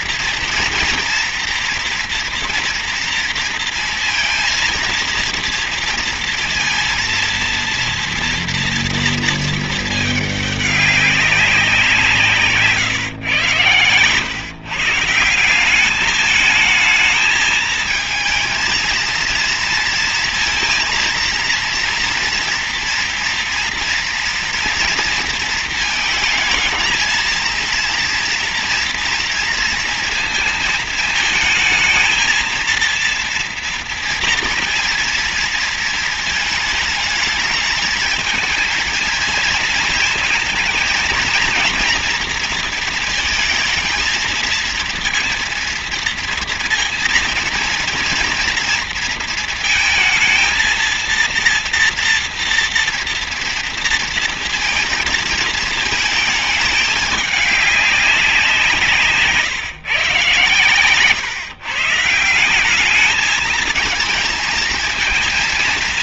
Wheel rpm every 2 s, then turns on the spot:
240, 240, 230, 230, 230, 200, 160, 130, 220, 220, 230, 240, 230, 220, 230, 230, 230, 230, 220, 230, 230, 230, 230, 230, 230, 230, 240, 230, 210, 180, 130, 180, 220.
none